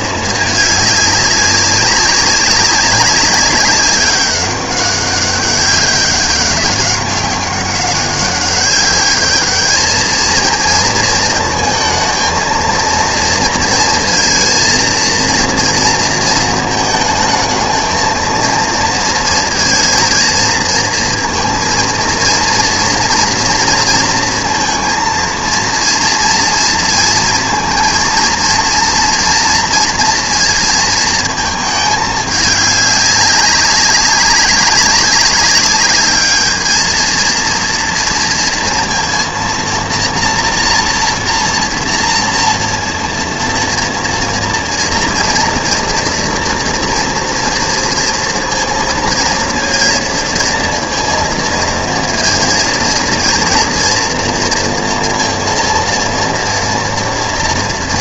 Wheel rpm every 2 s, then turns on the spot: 210, 200, 200, 190, 200, 230, 230, 230, 220, 230, 230, 230, 230, 230, 230, 230, 210, 190, 220, 230, 230, 230, 230, 230, 230, 230, 230, 230, 230.
none